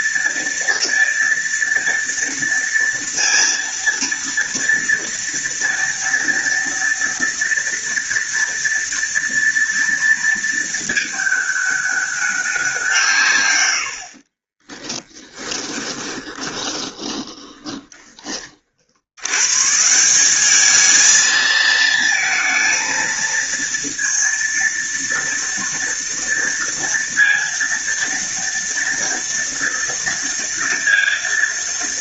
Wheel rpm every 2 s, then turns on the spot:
230, 230, 230, 230, 230, 220, 160, 30, 20, 90, 220, 230, 230, 230, 230, 230.
14-18